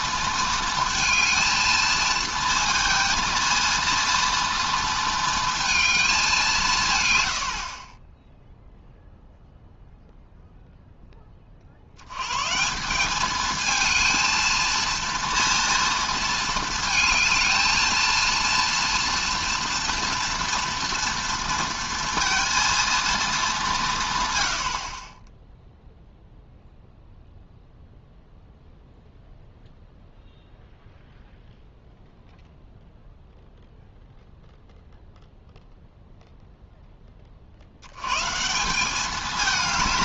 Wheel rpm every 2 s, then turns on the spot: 230, 230, 230, 170, 0, 0, 170, 230, 220, 230, 230, 230, 80, 0, 0, 0, 0, 0, 10, 170.
none